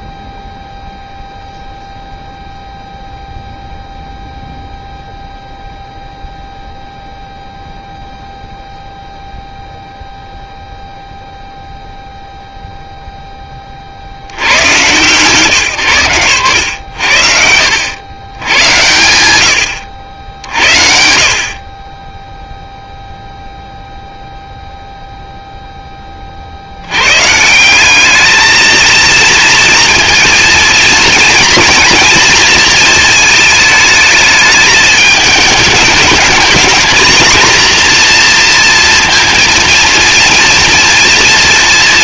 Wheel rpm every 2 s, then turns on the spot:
0, 0, 0, 0, 0, 0, 0, 120, 100, 110, 60, 0, 0, 140, 230, 230, 220, 210, 230, 230, 230.
none